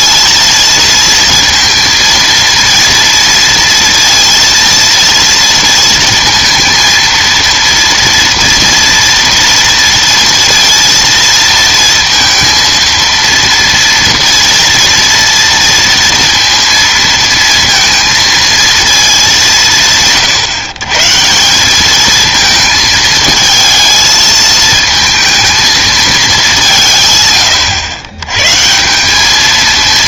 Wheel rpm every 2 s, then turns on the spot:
230, 230, 230, 230, 230, 230, 230, 240, 230, 230, 140, 220, 220, 170, 160.
none